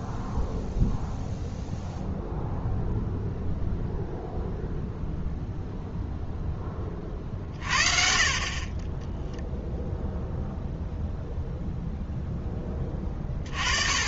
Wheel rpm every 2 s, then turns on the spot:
0, 0, 0, 20, 30, 0, 20.
none